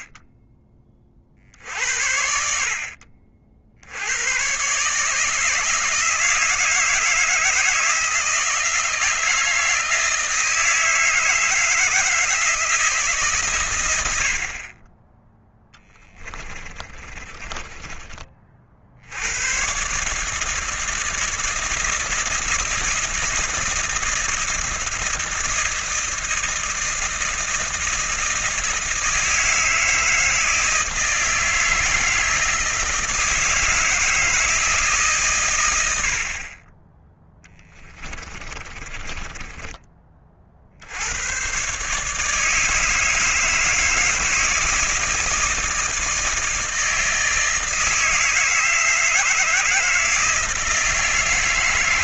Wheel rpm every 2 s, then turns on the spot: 30, 50, 160, 160, 160, 160, 130, 10, 20, 100, 160, 160, 160, 160, 160, 160, 160, 120, 10, 20, 100, 150, 160, 160, 160, 160.
14-18 36-40